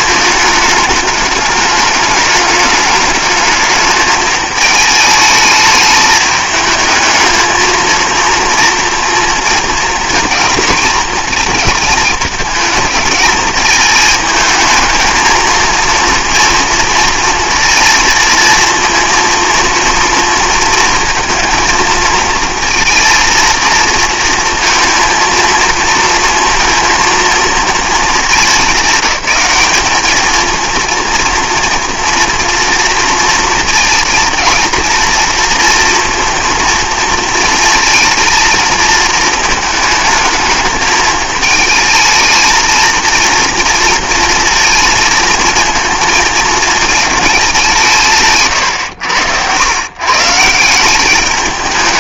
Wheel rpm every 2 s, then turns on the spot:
210, 210, 210, 220, 230, 230, 220, 220, 230, 230, 230, 230, 230, 230, 190, 230, 230, 230, 230, 230, 210, 220, 230, 220, 130, 170.
none